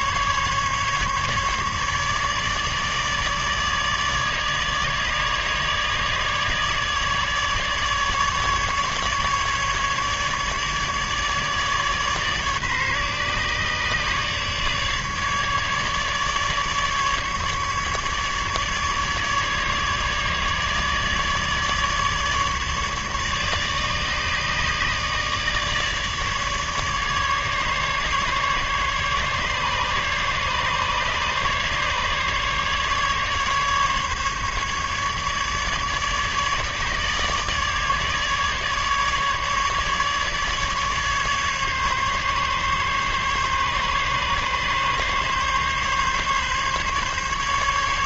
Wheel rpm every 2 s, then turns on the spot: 150, 150, 150, 150, 150, 150, 140, 150, 150, 150, 150, 150, 150, 150, 150, 140, 150, 150, 150, 150, 150, 140, 140, 140.
none